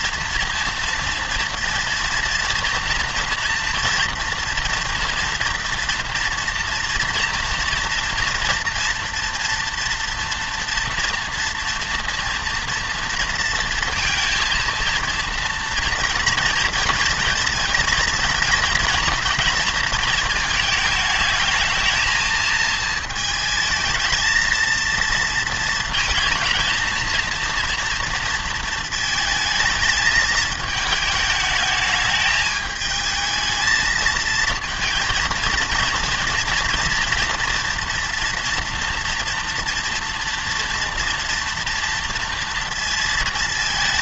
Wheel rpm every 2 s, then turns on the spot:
230, 230, 230, 230, 230, 230, 230, 230, 230, 230, 220, 220, 230, 220, 230, 220, 220, 230, 240, 230, 230, 230.
none